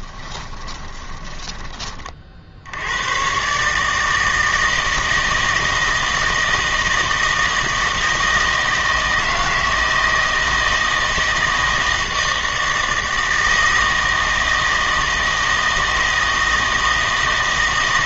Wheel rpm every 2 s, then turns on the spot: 20, 80, 160, 160, 160, 160, 160, 160, 160.
0-2